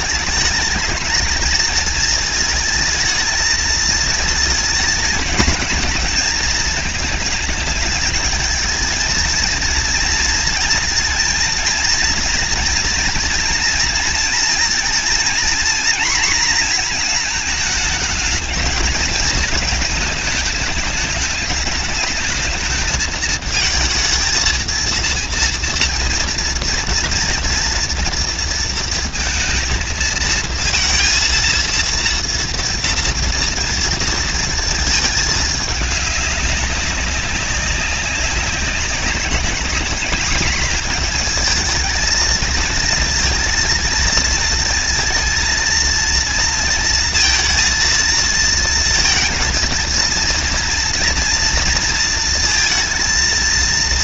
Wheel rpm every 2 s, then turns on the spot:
220, 220, 230, 220, 230, 230, 230, 240, 220, 220, 210, 220, 230, 230, 230, 230, 240, 220, 200, 200, 220, 230, 230, 230, 230, 230, 230.
none